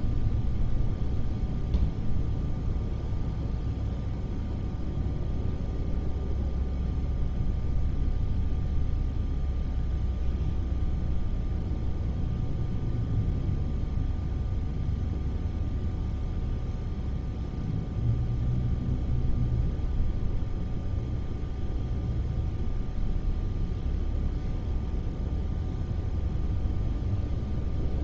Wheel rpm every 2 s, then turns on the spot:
0, 0, 0, 0, 0, 0, 0, 0, 0, 0, 0, 0, 0, 0.
none